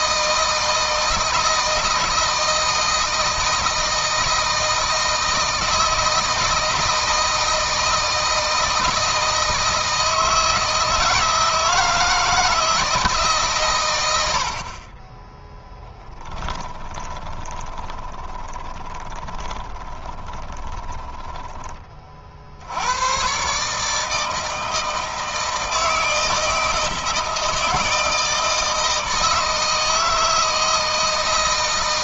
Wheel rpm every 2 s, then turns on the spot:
160, 160, 160, 160, 160, 160, 160, 50, 20, 20, 10, 80, 160, 160, 160, 160.
16-22